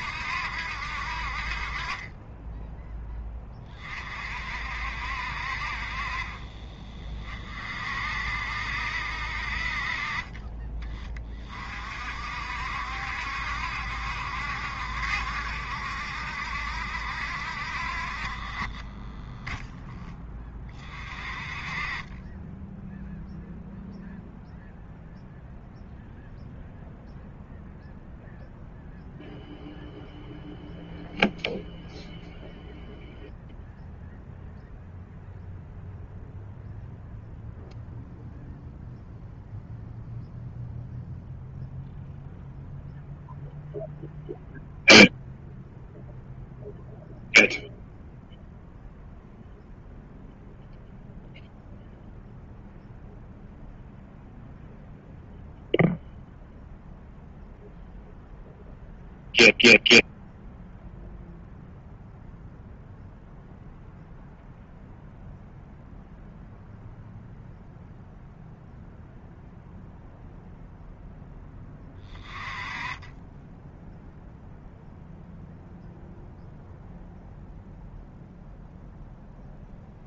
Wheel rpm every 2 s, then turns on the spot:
60, 10, 60, 40, 60, 20, 70, 70, 60, 20, 30, 10, 0, 0, 0, 0, 0, 0, 0, 0, 0, 0, 0, 0, 0, 0, 0, 0, 0, 0, 0, 0, 0, 0, 0, 0, 20, 0, 0, 0.
none